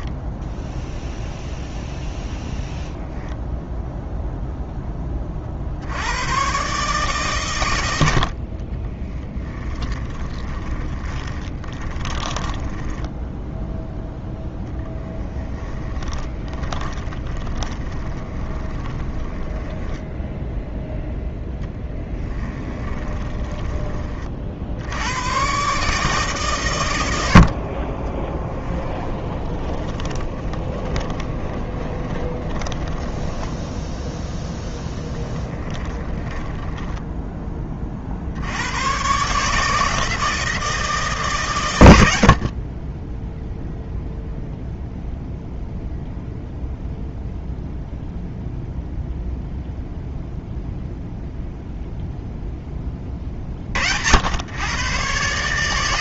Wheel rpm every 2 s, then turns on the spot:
0, 0, 10, 130, 30, 20, 10, 0, 10, 20, 10, 20, 70, 110, 20, 30, 20, 0, 10, 100, 160, 20, 0, 0, 0, 0, 20, 120.
8-14 16-20 22-24 28-34 36-38